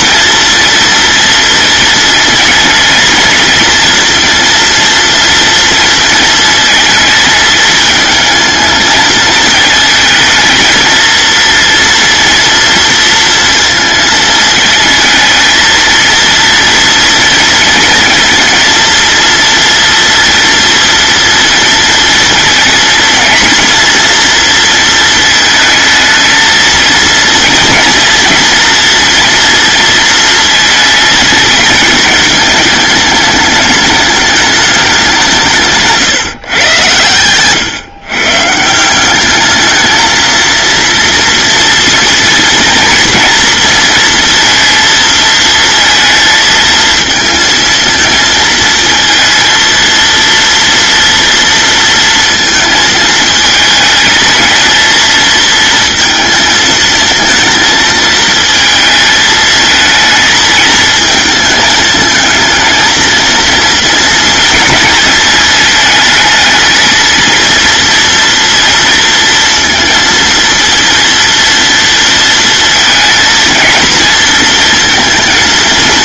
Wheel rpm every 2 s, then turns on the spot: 230, 230, 230, 220, 220, 230, 230, 220, 230, 230, 230, 230, 230, 230, 230, 220, 210, 190, 120, 190, 230, 230, 230, 230, 230, 230, 220, 230, 230, 220, 220, 230, 220, 230, 230, 230, 230, 220.
none